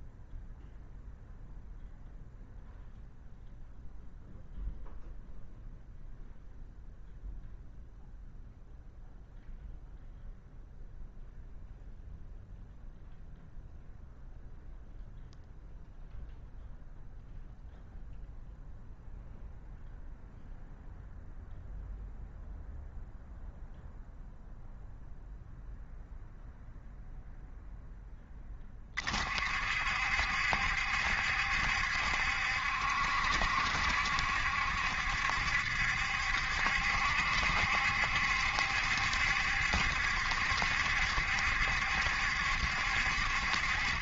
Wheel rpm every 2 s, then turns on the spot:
0, 0, 0, 0, 0, 0, 0, 0, 0, 0, 0, 0, 0, 0, 30, 70, 70, 70, 70, 70, 70, 60.
none